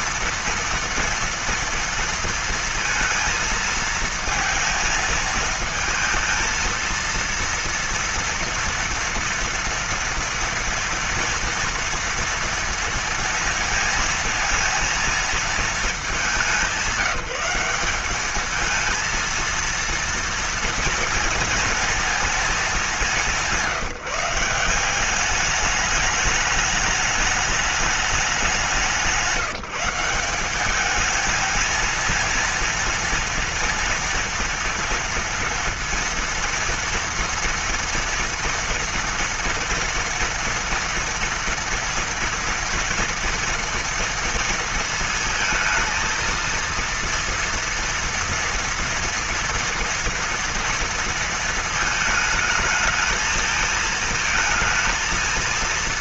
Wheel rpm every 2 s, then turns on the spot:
230, 230, 220, 230, 230, 240, 230, 230, 200, 210, 230, 220, 170, 210, 190, 190, 230, 230, 230, 230, 230, 230, 230, 230, 230, 230, 220, 230.
none